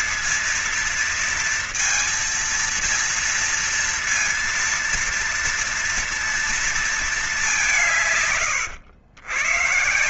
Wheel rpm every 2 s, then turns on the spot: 230, 230, 230, 230, 150.
none